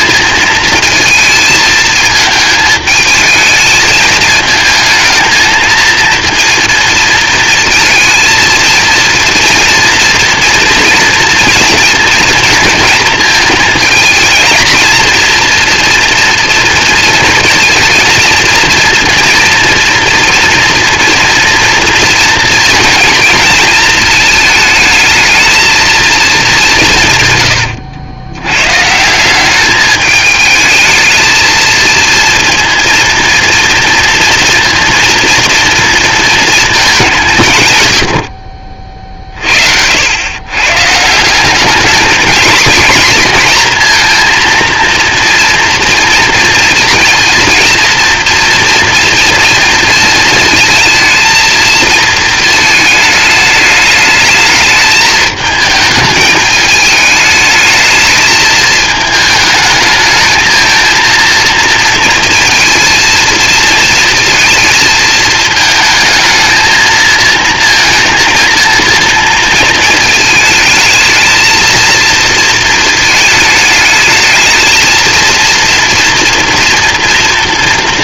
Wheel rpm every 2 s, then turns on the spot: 220, 220, 230, 230, 230, 230, 230, 220, 230, 230, 230, 240, 220, 200, 120, 220, 230, 230, 220, 50, 120, 240, 230, 230, 230, 230, 220, 220, 210, 220, 220, 230, 220, 220, 230, 220, 230, 220, 230.
none